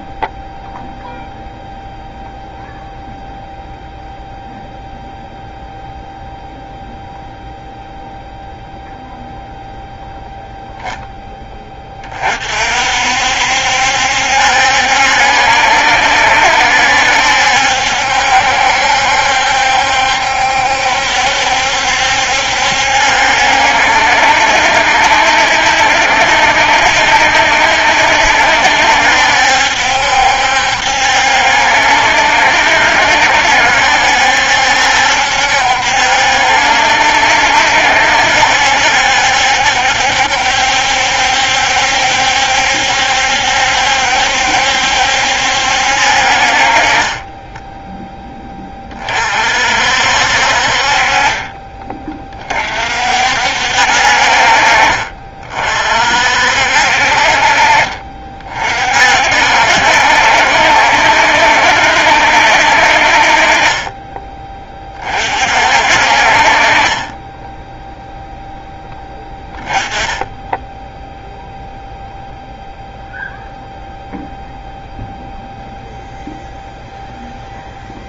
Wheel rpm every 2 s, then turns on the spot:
0, 0, 0, 0, 0, 0, 50, 70, 70, 70, 70, 70, 70, 70, 70, 70, 60, 70, 70, 70, 70, 70, 70, 40, 30, 50, 40, 40, 60, 50, 70, 60, 20, 40, 0, 10, 0, 0, 0.
none